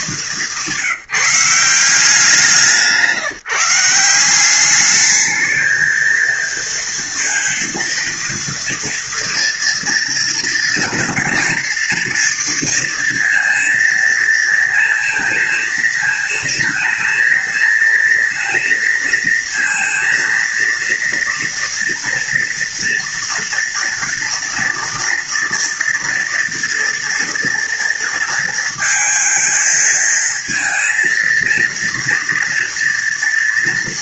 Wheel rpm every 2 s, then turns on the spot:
180, 160, 190, 230, 230, 230, 230, 230, 220, 230, 230, 230, 230, 230, 230, 230, 230.
none